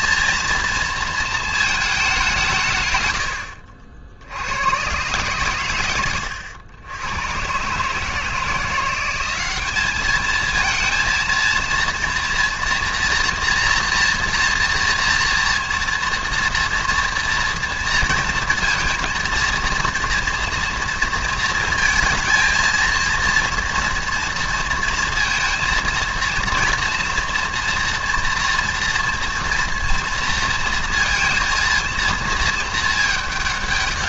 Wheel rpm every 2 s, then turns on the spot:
230, 140, 110, 100, 170, 220, 230, 230, 240, 230, 230, 220, 230, 230, 240, 230, 220.
none